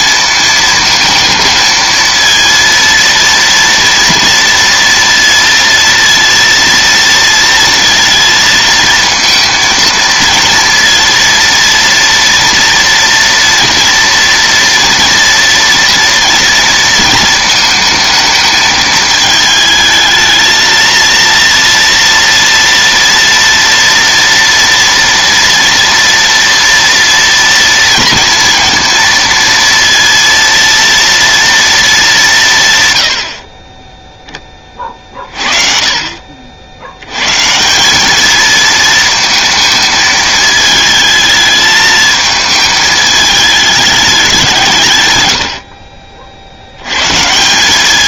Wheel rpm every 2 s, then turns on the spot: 220, 230, 230, 230, 230, 230, 230, 230, 230, 220, 230, 230, 230, 230, 230, 230, 50, 40, 130, 230, 220, 220, 90, 150.
44-46